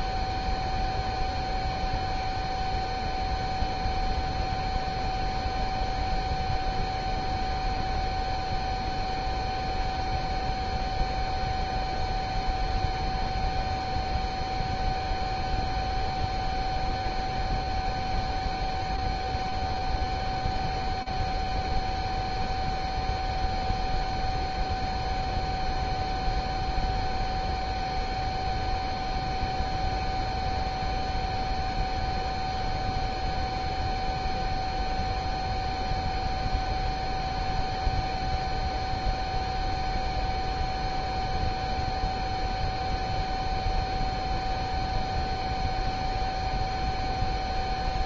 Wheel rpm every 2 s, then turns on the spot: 0, 0, 0, 0, 0, 0, 0, 0, 0, 0, 0, 0, 0, 0, 0, 0, 0, 0, 0, 0, 0, 0, 0, 0.
none